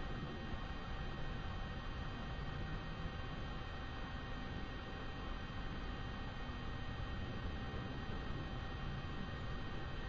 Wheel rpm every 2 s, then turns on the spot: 0, 0, 0, 0, 0.
none